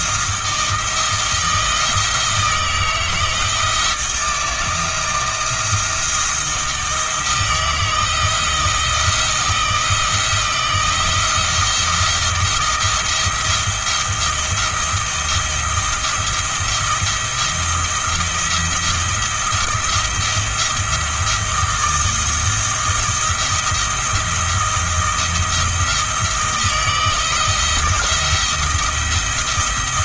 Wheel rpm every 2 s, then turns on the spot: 160, 160, 170, 160, 160, 170, 170, 170, 170, 170, 170, 170, 170, 160, 170.
none